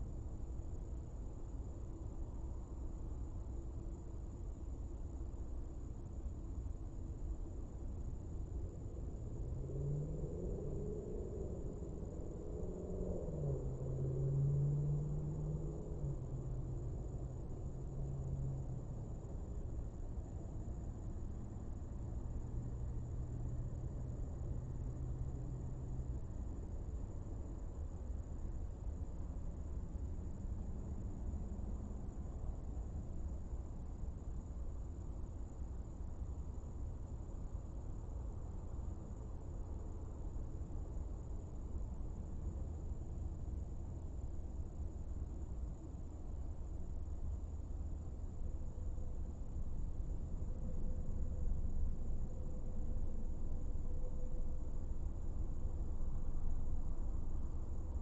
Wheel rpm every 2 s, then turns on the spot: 0, 0, 0, 0, 0, 0, 0, 0, 0, 0, 0, 0, 0, 0, 0, 0, 0, 0, 0, 0, 0, 0, 0, 0, 0, 0, 0, 0, 0.
none